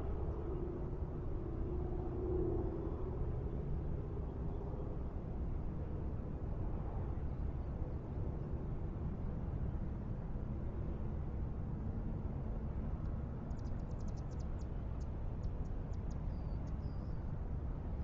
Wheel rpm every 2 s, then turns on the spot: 0, 0, 0, 0, 0, 0, 0, 0, 0.
none